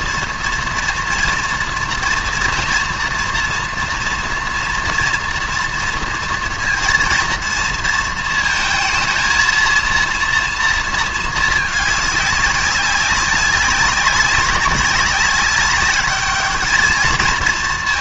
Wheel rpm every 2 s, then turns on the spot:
230, 230, 230, 230, 220, 230, 190, 190, 220.
none